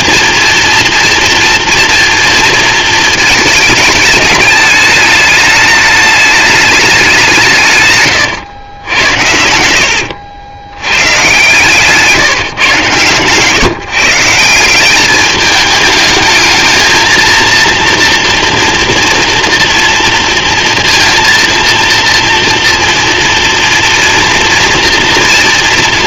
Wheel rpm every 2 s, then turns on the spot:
240, 230, 220, 210, 140, 100, 150, 160, 220, 230, 230, 230, 230.
8-12